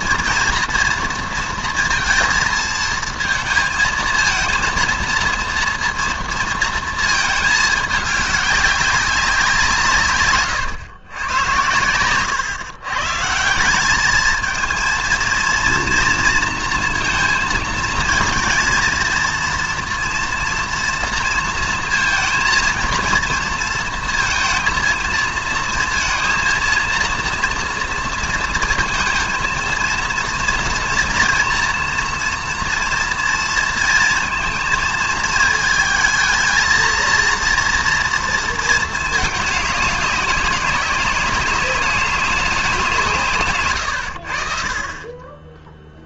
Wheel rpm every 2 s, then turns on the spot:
230, 220, 230, 230, 200, 130, 130, 220, 230, 230, 230, 230, 230, 230, 230, 230, 240, 230, 220, 220, 200, 180, 50.
none